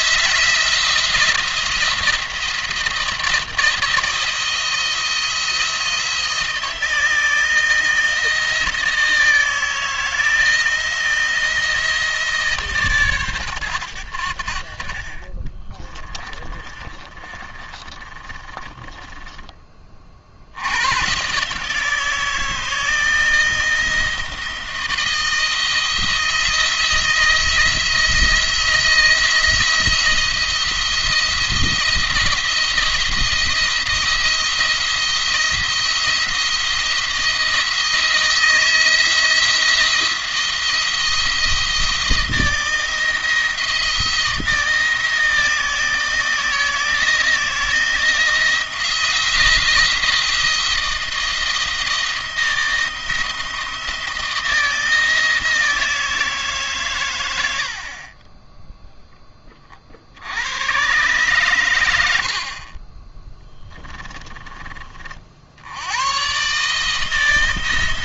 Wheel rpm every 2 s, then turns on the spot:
170, 160, 170, 170, 160, 160, 150, 60, 20, 20, 90, 160, 170, 170, 170, 170, 170, 170, 170, 160, 170, 170, 160, 160, 170, 170, 170, 170, 140, 10, 110, 40, 30, 150.
16-20